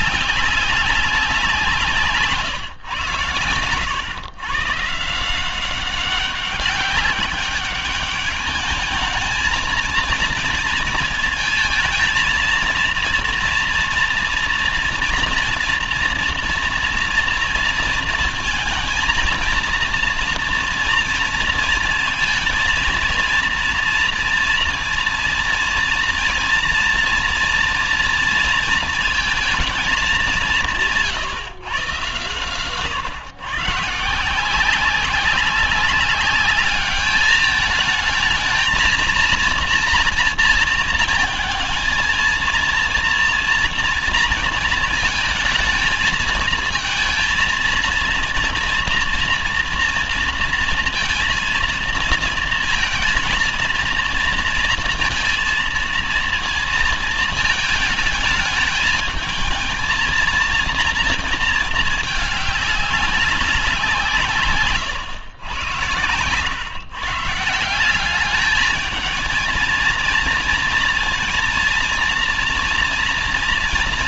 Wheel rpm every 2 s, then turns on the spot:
190, 150, 130, 190, 210, 230, 230, 230, 230, 230, 230, 230, 230, 230, 230, 190, 120, 180, 200, 220, 230, 230, 230, 230, 230, 230, 230, 230, 230, 220, 230, 200, 150, 100, 210, 230, 230.
none